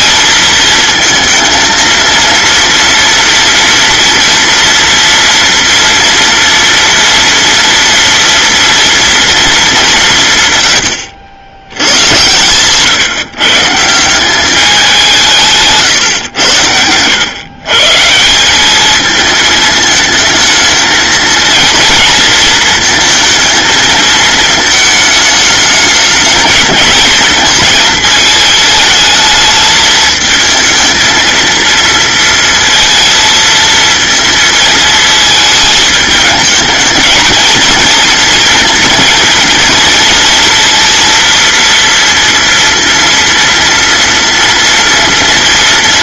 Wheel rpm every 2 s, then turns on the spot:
220, 230, 230, 230, 230, 100, 130, 200, 100, 210, 220, 230, 220, 220, 220, 220, 230, 220, 220, 230, 230, 230, 230.
none